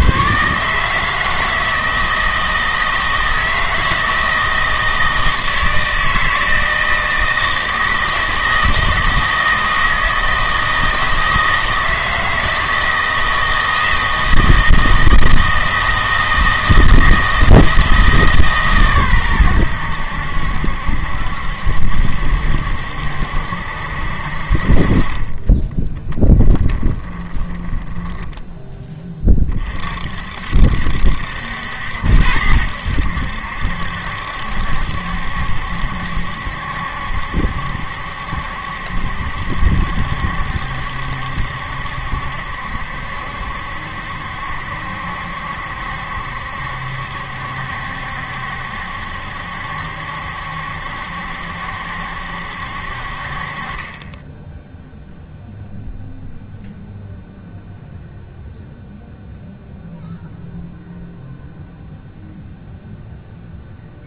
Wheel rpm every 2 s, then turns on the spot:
150, 160, 160, 160, 160, 160, 160, 160, 160, 130, 70, 70, 40, 10, 20, 70, 80, 70, 70, 70, 70, 70, 70, 70, 70, 70, 60, 0, 0, 0, 0, 0.
26-28